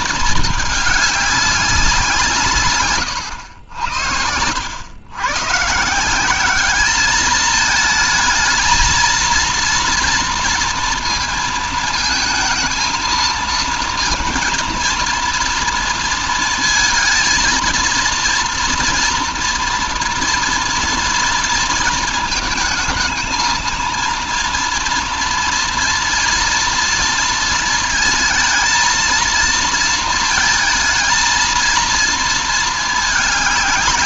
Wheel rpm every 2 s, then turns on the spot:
210, 120, 110, 210, 230, 230, 220, 230, 230, 230, 230, 220, 230, 230, 230, 230, 210.
none